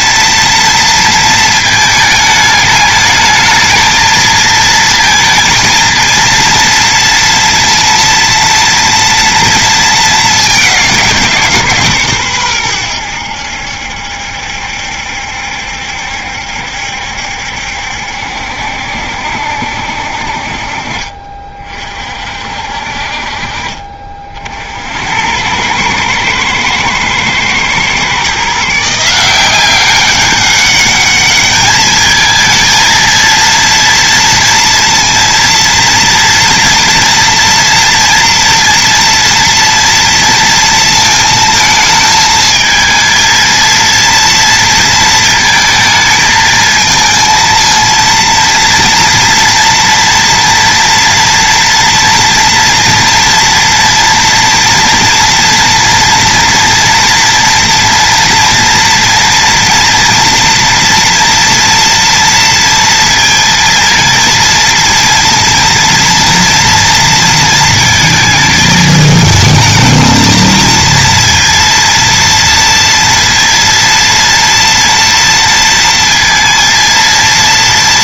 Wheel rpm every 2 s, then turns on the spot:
230, 210, 230, 230, 230, 200, 100, 70, 70, 70, 40, 50, 60, 110, 150, 200, 220, 230, 230, 240, 230, 220, 230, 220, 230, 230, 230, 230, 230, 230, 230, 230, 230, 230, 220, 230, 230, 230, 230.
20-22